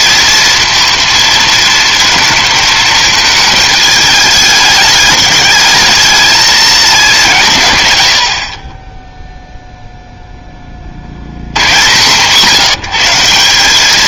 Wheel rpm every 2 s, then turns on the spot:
230, 220, 210, 210, 30, 30, 170.
none